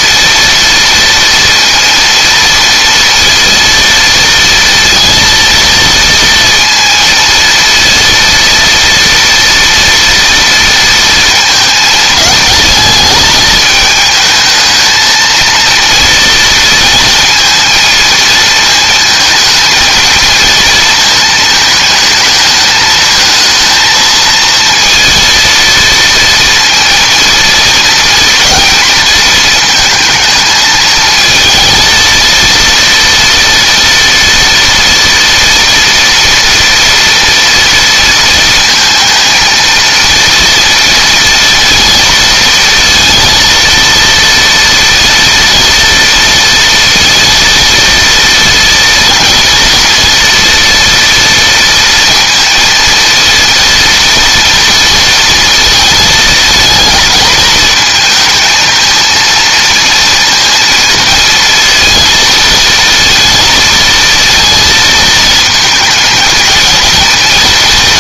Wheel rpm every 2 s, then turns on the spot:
230, 230, 230, 230, 230, 230, 220, 220, 230, 220, 230, 220, 230, 240, 220, 220, 230, 230, 230, 230, 230, 230, 230, 230, 230, 230, 230, 230, 220, 220, 230, 220, 220, 220.
none